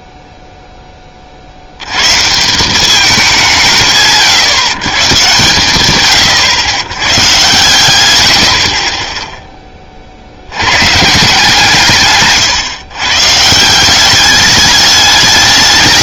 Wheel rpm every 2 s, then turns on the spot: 0, 180, 130, 110, 50, 100, 140, 200.
none